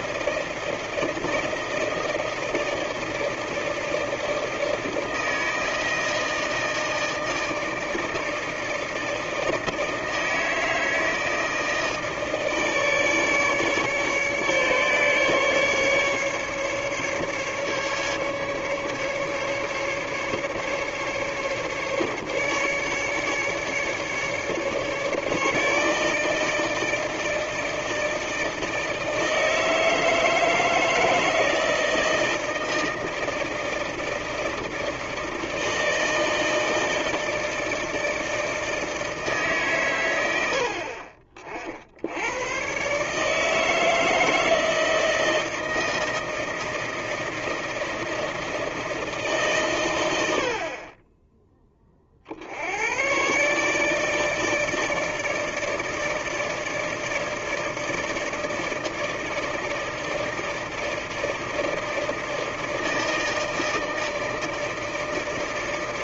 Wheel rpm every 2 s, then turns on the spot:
160, 160, 160, 160, 160, 160, 150, 150, 140, 150, 150, 150, 150, 160, 160, 160, 160, 160, 160, 160, 70, 120, 160, 160, 160, 50, 90, 160, 160, 160, 160, 160, 160.
none